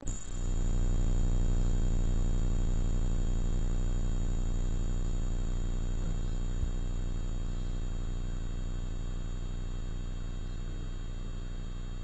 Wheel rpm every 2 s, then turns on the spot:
0, 0, 0, 0, 0, 0.
none